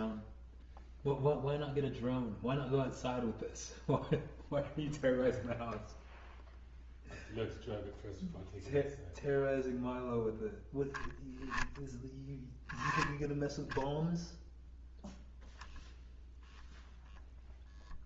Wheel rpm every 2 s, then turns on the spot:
0, 0, 0, 0, 0, 0, 10, 0, 0.
none